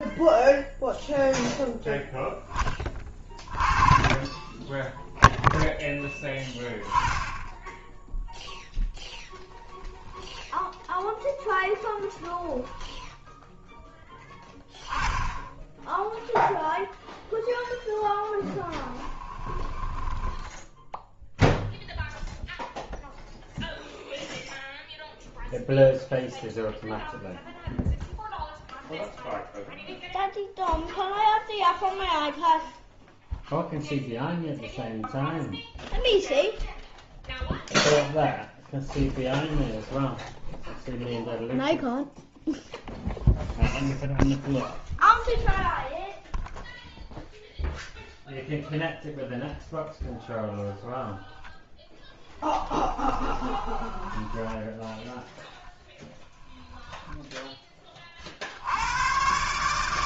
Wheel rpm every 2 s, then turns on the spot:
0, 20, 10, 10, 0, 0, 0, 10, 0, 10, 0, 0, 0, 0, 0, 0, 0, 0, 0, 0, 0, 0, 0, 0, 0, 0, 10, 0, 10, 80.
18-20 52-54